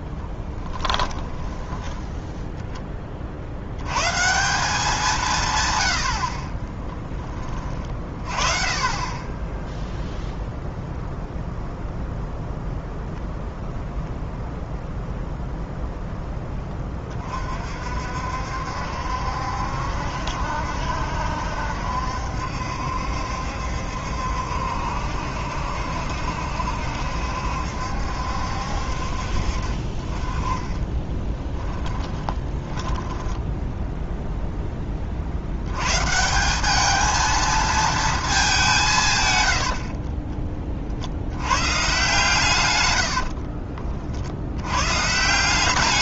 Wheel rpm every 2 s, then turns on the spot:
10, 10, 180, 20, 30, 0, 0, 0, 20, 60, 70, 70, 70, 70, 60, 20, 20, 10, 200, 180, 30, 120, 90.
0-2 30-34